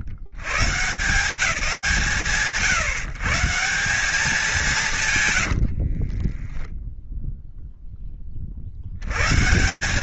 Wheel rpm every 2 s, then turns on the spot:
70, 140, 190, 20, 40.
6-8